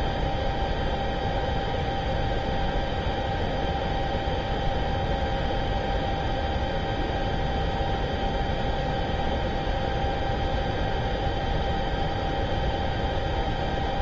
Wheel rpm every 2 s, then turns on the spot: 0, 0, 0, 0, 0, 0, 0.
none